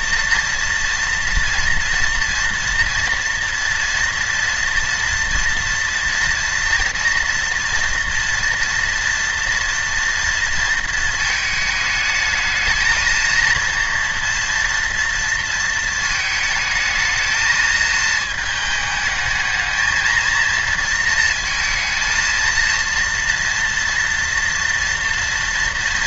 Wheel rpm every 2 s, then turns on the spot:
230, 240, 230, 230, 230, 230, 220, 230, 220, 220, 230, 230, 230.
none